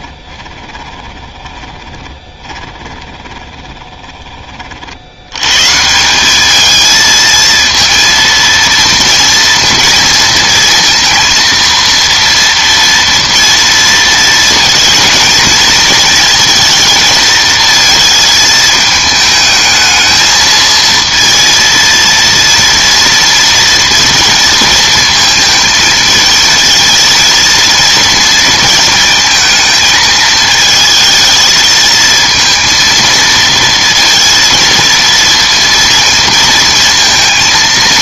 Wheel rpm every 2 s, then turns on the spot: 20, 30, 40, 220, 230, 230, 230, 230, 230, 220, 230, 230, 230, 220, 220, 220, 230, 230, 230.
0-4